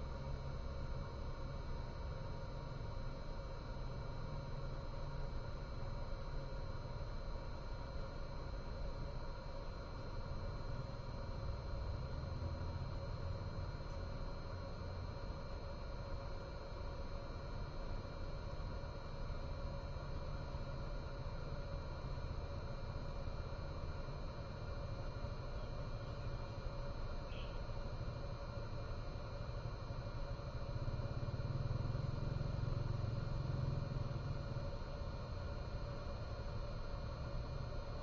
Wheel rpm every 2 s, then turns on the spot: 0, 0, 0, 0, 0, 0, 0, 0, 0, 0, 0, 0, 0, 0, 0, 0, 0, 0, 0.
none